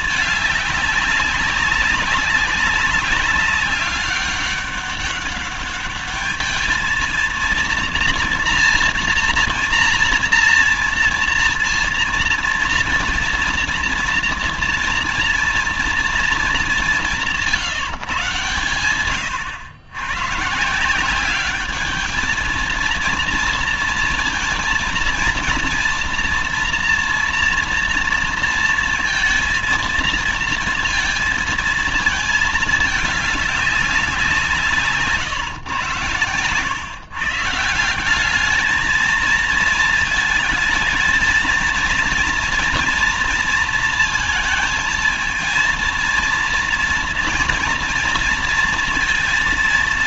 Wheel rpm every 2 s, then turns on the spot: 210, 190, 200, 220, 240, 230, 230, 240, 210, 120, 150, 220, 230, 230, 230, 230, 210, 160, 120, 210, 220, 230, 230, 230, 230.
none